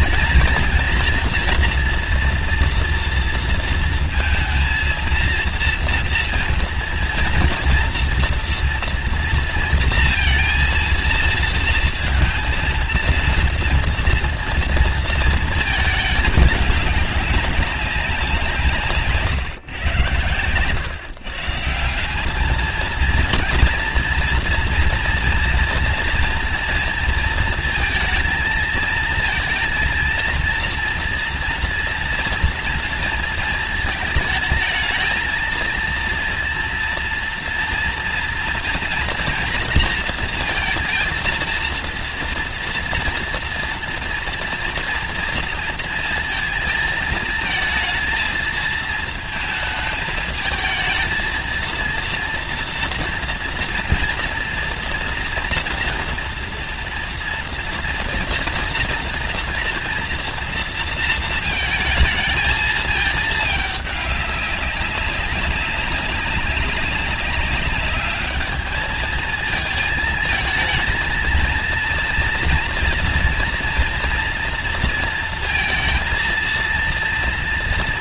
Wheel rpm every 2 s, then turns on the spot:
230, 230, 230, 230, 230, 230, 230, 230, 210, 160, 110, 220, 230, 230, 220, 230, 230, 220, 230, 230, 230, 230, 230, 220, 230, 220, 230, 230, 240, 230, 230, 220, 200, 200, 210, 230, 240, 230, 230.
none